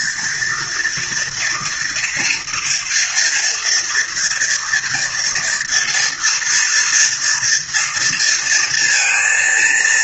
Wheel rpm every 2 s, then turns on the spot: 230, 230, 240, 240, 230.
none